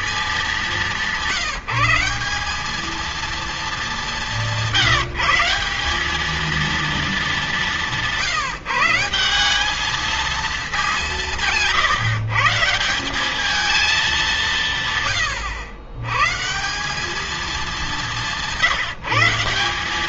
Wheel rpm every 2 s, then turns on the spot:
180, 220, 180, 230, 170, 190, 170, 140, 160, 180.
none